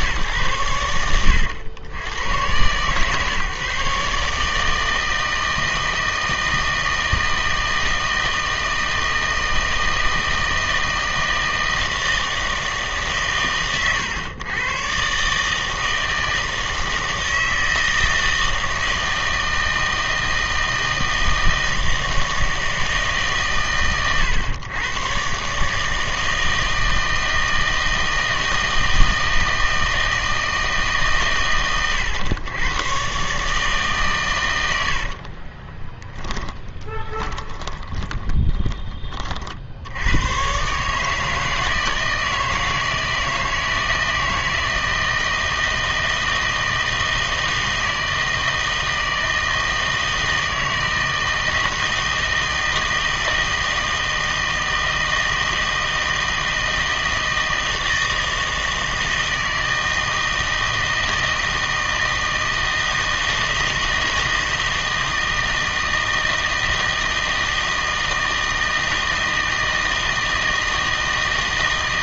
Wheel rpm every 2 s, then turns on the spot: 110, 120, 150, 160, 160, 160, 160, 120, 160, 160, 160, 160, 110, 160, 160, 160, 110, 90, 10, 20, 130, 160, 160, 160, 160, 160, 160, 160, 160, 160, 160, 160, 160, 160, 160, 160.
36-40